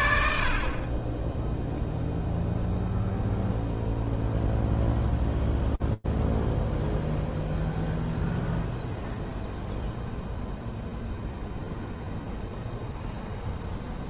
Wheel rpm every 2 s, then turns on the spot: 40, 0, 0, 0, 0, 0, 0.
none